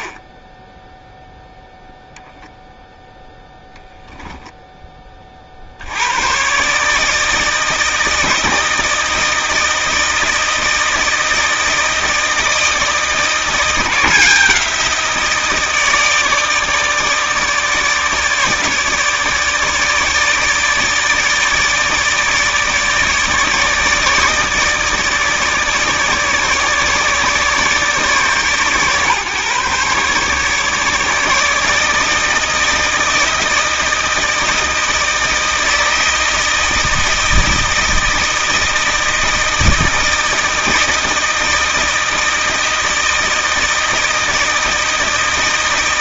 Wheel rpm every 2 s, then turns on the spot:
0, 10, 20, 150, 160, 160, 160, 170, 150, 150, 160, 160, 160, 150, 130, 150, 160, 160, 160, 160, 160, 160, 160.
none